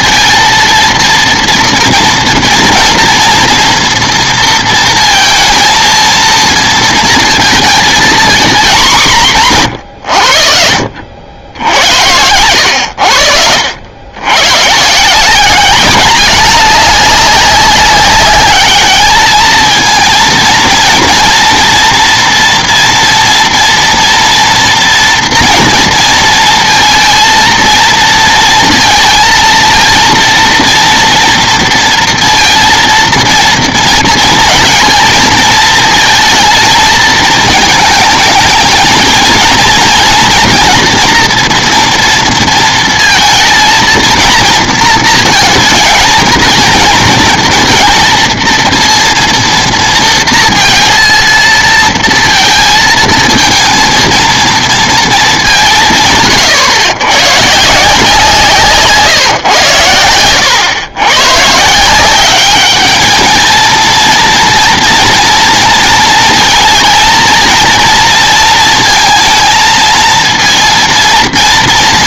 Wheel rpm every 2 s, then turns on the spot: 230, 240, 230, 230, 220, 70, 90, 130, 200, 210, 230, 230, 230, 230, 230, 230, 230, 230, 230, 220, 230, 230, 230, 230, 230, 230, 220, 230, 110, 150, 110, 210, 230, 230, 230, 230.
none